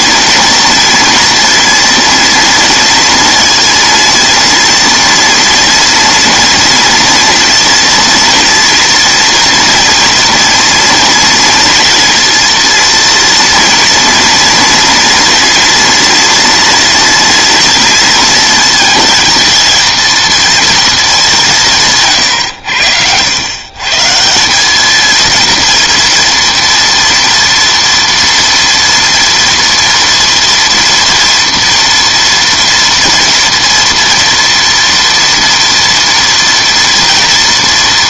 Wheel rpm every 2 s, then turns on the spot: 230, 230, 230, 240, 230, 230, 230, 230, 230, 230, 240, 110, 190, 230, 230, 230, 230, 240, 230.
none